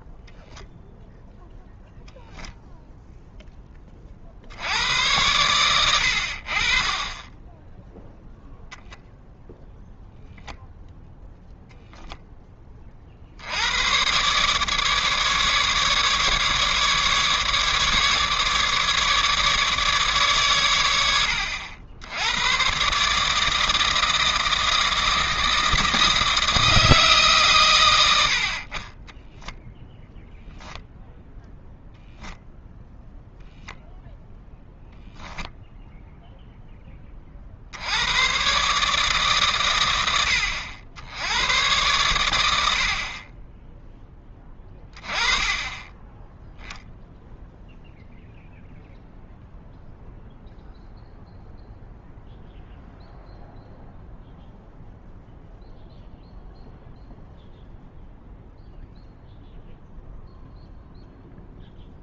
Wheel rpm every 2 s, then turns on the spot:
0, 0, 80, 40, 0, 0, 30, 150, 150, 150, 110, 130, 160, 160, 40, 0, 0, 0, 10, 140, 80, 80, 20, 0, 0, 0, 0, 0, 0, 0, 0.
none